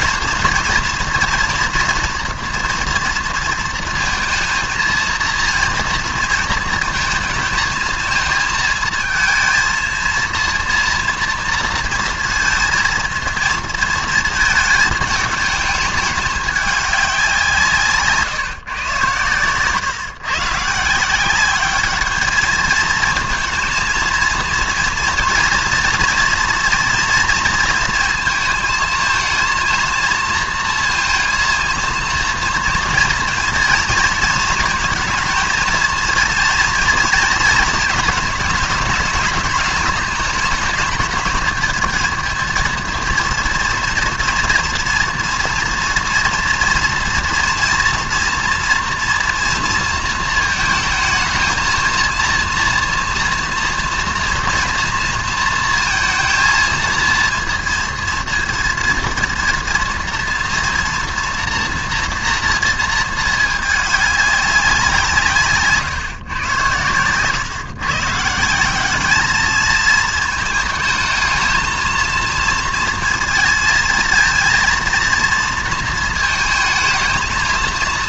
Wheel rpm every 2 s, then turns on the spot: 230, 230, 230, 230, 220, 230, 230, 220, 200, 130, 160, 220, 230, 230, 220, 230, 230, 220, 230, 220, 210, 230, 230, 230, 230, 220, 240, 230, 230, 230, 230, 220, 180, 110, 200, 220, 230, 230, 220.
none